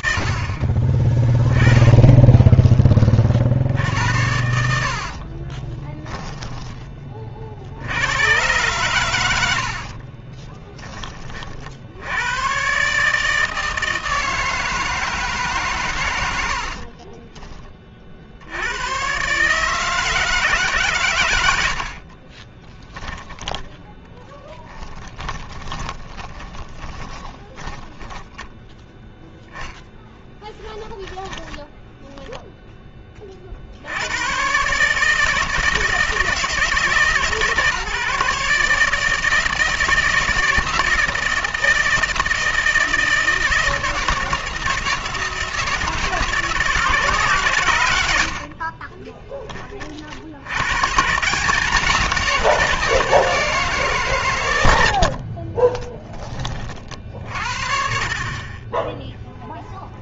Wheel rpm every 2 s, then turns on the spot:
80, 20, 80, 30, 120, 10, 140, 160, 40, 130, 100, 10, 20, 20, 0, 10, 40, 160, 150, 160, 160, 160, 160, 130, 10, 160, 170, 40, 60, 0.
2-8 16-18 20-22 24-28 30-32 54-56